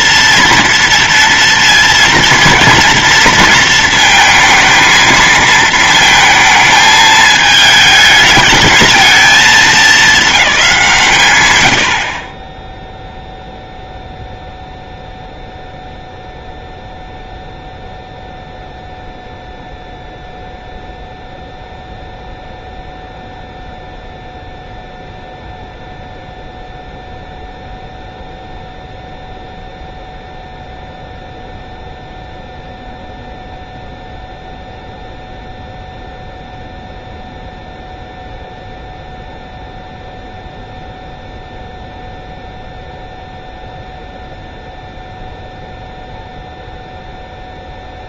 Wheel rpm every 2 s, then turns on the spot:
230, 230, 230, 220, 220, 180, 0, 0, 0, 0, 0, 0, 0, 0, 0, 0, 0, 0, 0, 0, 0, 0, 0, 0.
none